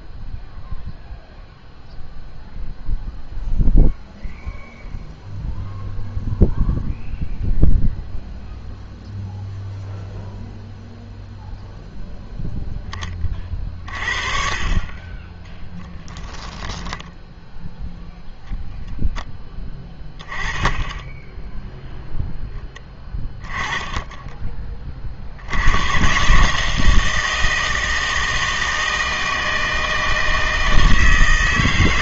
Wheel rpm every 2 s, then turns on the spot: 0, 0, 0, 0, 0, 0, 10, 40, 10, 0, 10, 10, 20, 150, 160, 160.
16-18 20-22